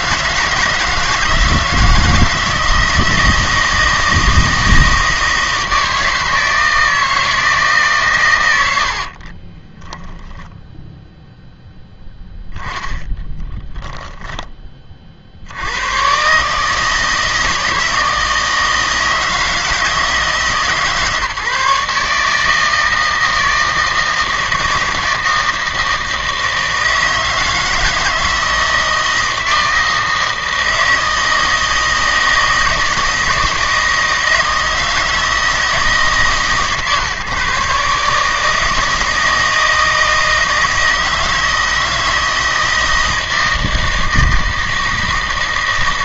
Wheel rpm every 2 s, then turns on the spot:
160, 160, 160, 160, 70, 0, 10, 30, 160, 160, 150, 160, 160, 160, 160, 160, 160, 160, 140, 160, 160, 160, 160.
8-10